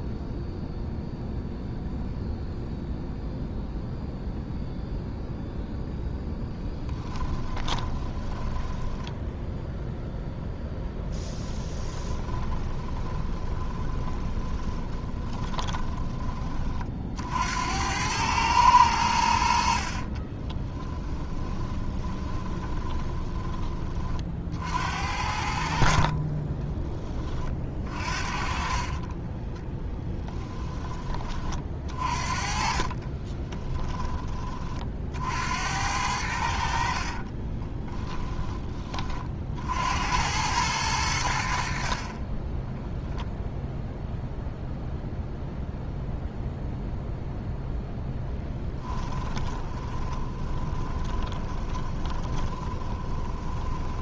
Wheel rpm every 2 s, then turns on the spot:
0, 0, 0, 10, 10, 10, 30, 20, 40, 100, 30, 20, 70, 20, 30, 20, 30, 50, 50, 20, 90, 0, 0, 0, 10, 20, 20.
6-16 20-24 28-30 32-34 36-38 48-54